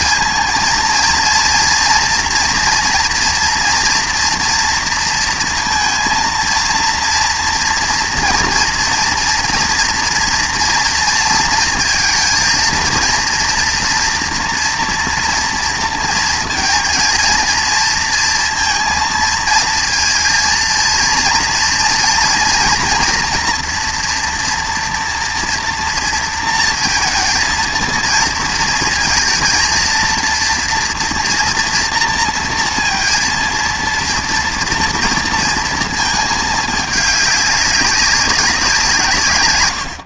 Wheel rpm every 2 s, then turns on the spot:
230, 240, 230, 230, 230, 230, 230, 240, 230, 230, 230, 230, 230, 230, 230, 230, 230, 230, 210, 180.
none